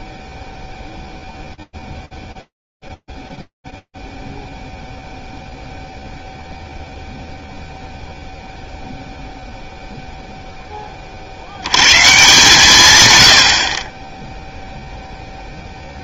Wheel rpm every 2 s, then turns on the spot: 0, 0, 0, 0, 0, 20, 130, 0.
none